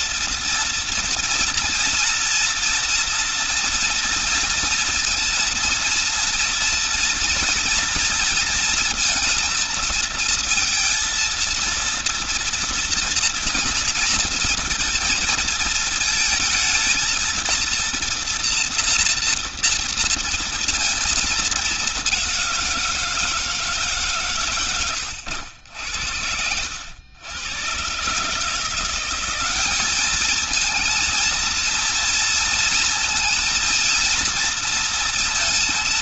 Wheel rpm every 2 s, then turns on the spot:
230, 230, 230, 230, 230, 230, 230, 230, 220, 230, 230, 180, 130, 90, 160, 220, 230, 230.
none